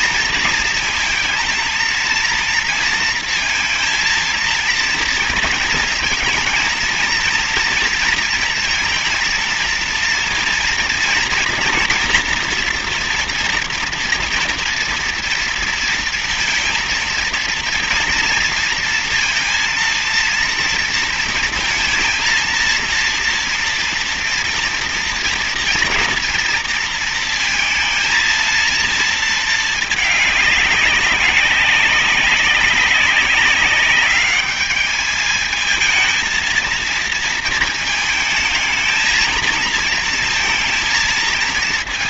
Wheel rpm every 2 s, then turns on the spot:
220, 230, 230, 230, 230, 230, 240, 230, 230, 230, 230, 230, 230, 230, 230, 210, 190, 200, 230, 220, 230.
none